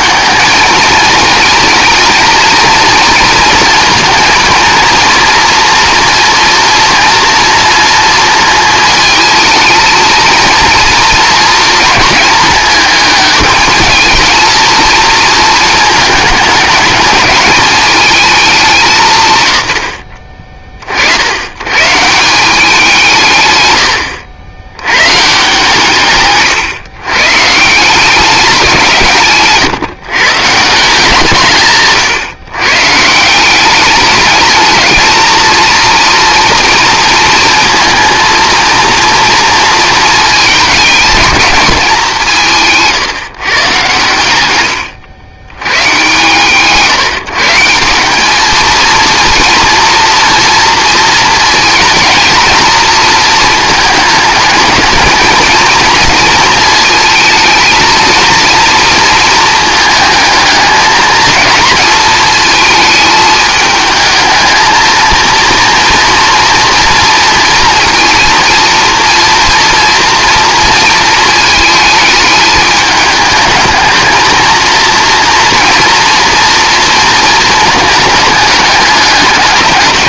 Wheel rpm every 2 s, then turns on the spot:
220, 230, 230, 240, 220, 230, 220, 230, 210, 200, 40, 180, 80, 140, 180, 160, 130, 220, 230, 230, 220, 160, 100, 130, 220, 230, 220, 220, 230, 230, 220, 220, 220, 230, 230, 230, 210, 230, 230, 210.
none